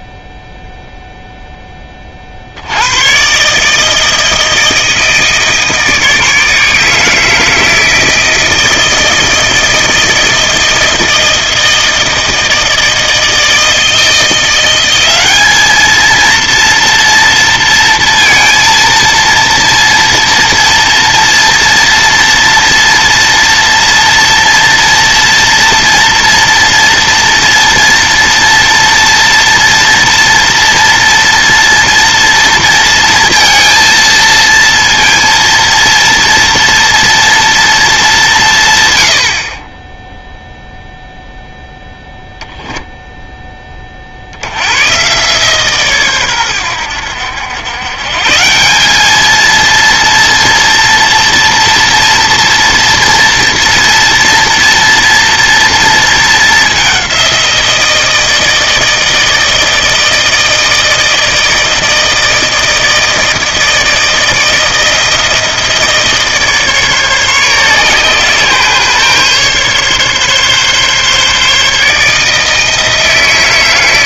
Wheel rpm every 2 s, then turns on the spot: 0, 80, 160, 160, 160, 160, 160, 180, 230, 230, 230, 230, 230, 230, 230, 230, 230, 230, 230, 140, 0, 0, 90, 100, 180, 230, 230, 230, 200, 160, 160, 160, 160, 150, 130, 140, 160.
none